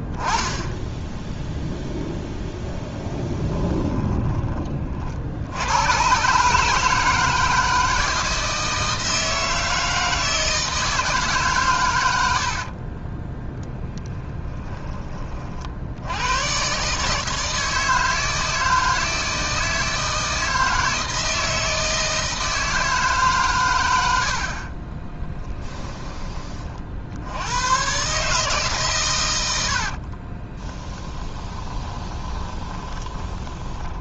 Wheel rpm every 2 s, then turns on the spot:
10, 10, 40, 160, 160, 160, 30, 20, 140, 160, 160, 150, 30, 60, 140, 20, 20.
12-14 24-26 30-34